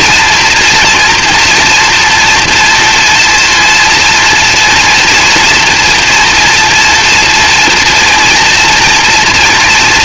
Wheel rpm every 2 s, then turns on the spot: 230, 230, 240, 240, 240.
none